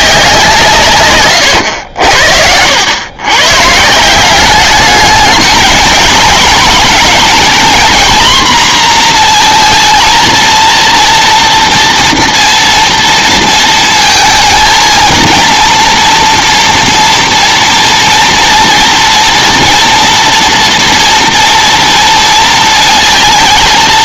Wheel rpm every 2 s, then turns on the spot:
170, 80, 200, 230, 240, 230, 230, 220, 230, 230, 230, 230.
none